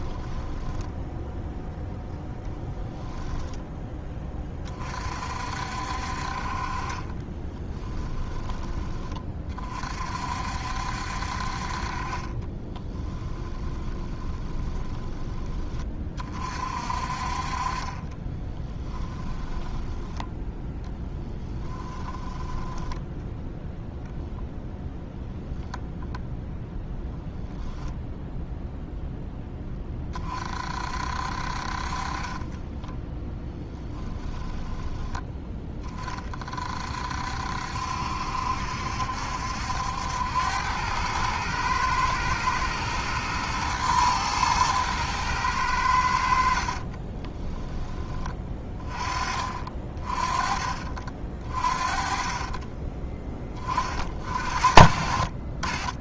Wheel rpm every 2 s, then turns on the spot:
10, 10, 30, 40, 20, 60, 30, 20, 40, 10, 0, 10, 0, 0, 0, 50, 20, 10, 50, 70, 100, 120, 110, 40, 30, 30, 30, 60.
0-2 6-8 12-16 18-20 32-36 46-48 52-54